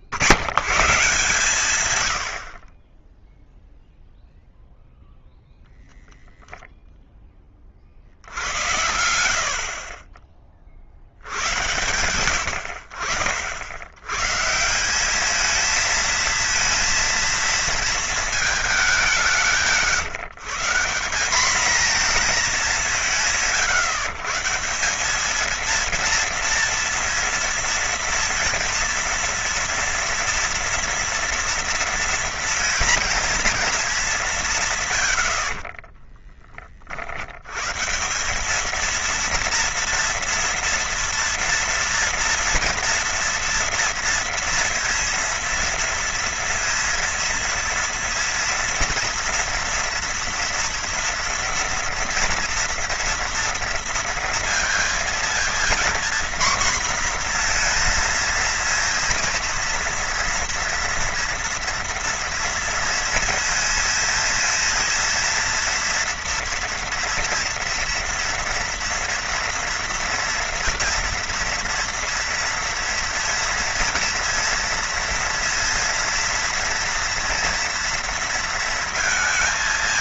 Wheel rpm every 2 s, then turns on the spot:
110, 70, 0, 0, 80, 60, 70, 200, 230, 190, 170, 180, 190, 230, 230, 230, 230, 110, 50, 230, 230, 230, 230, 230, 230, 230, 230, 230, 240, 230, 230, 230, 230, 230, 230, 230, 230, 230, 230, 230.
none